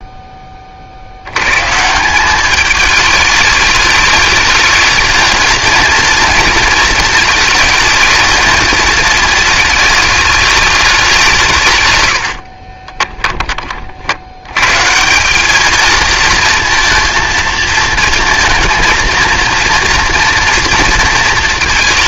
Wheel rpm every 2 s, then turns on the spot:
50, 220, 220, 220, 220, 210, 30, 140, 230, 220, 230.
12-14